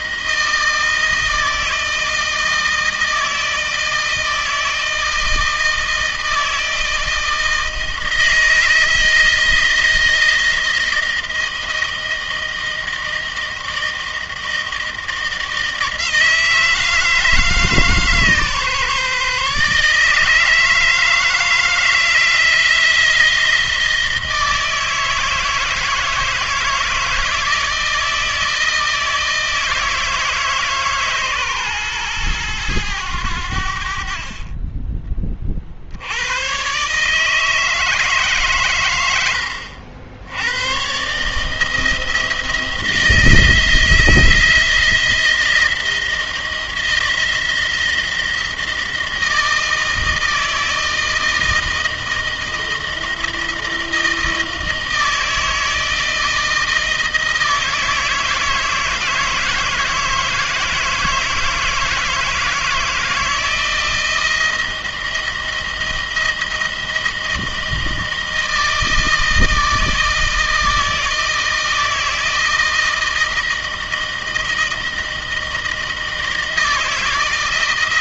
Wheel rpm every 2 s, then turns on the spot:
160, 160, 160, 160, 160, 160, 160, 160, 160, 150, 160, 160, 160, 160, 160, 150, 110, 30, 130, 120, 120, 160, 170, 170, 160, 160, 160, 160, 160, 160, 160, 160, 170, 160, 160, 160, 160, 160, 160.
none